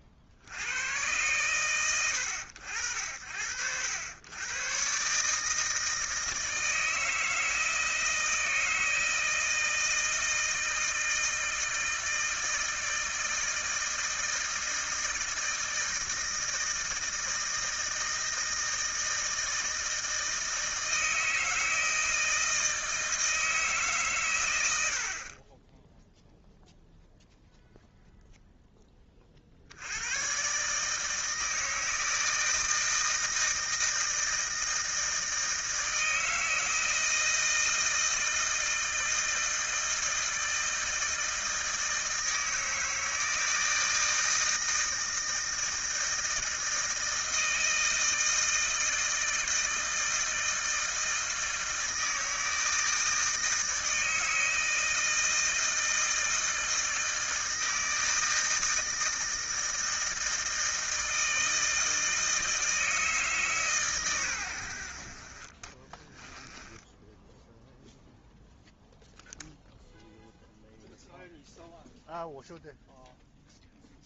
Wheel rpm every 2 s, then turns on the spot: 50, 70, 120, 160, 160, 160, 160, 160, 160, 160, 160, 160, 90, 0, 0, 140, 160, 160, 160, 160, 160, 160, 160, 160, 160, 160, 160, 160, 160, 160, 160, 160, 80, 10, 0, 0, 0.
66-68